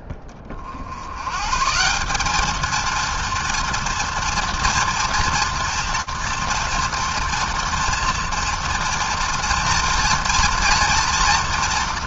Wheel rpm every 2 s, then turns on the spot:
30, 210, 240, 230, 230, 230.
none